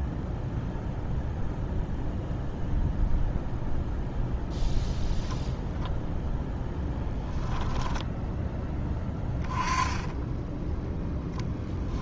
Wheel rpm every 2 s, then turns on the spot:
0, 0, 0, 10, 10, 10.
6-8